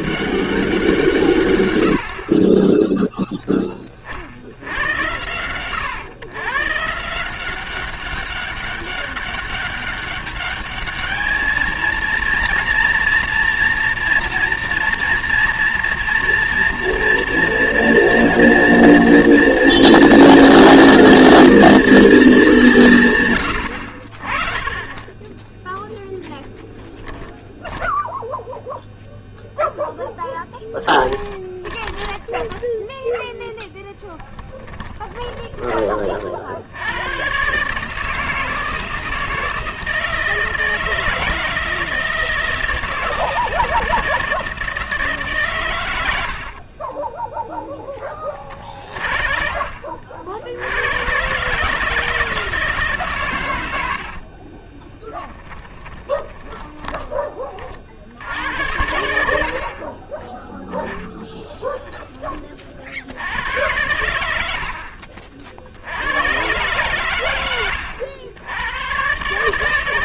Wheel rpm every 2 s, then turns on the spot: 180, 30, 90, 120, 200, 210, 230, 230, 230, 230, 240, 200, 30, 10, 0, 10, 10, 10, 60, 160, 160, 160, 160, 50, 30, 80, 160, 30, 20, 80, 10, 30, 70, 120, 90.
2-4 30-36 46-48 54-58 64-66